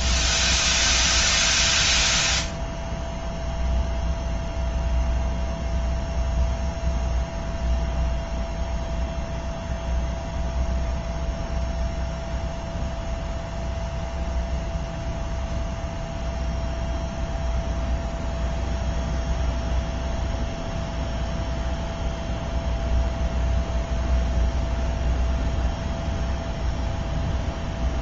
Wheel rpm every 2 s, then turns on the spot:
0, 0, 0, 0, 0, 0, 0, 0, 0, 0, 0, 0, 0, 0.
none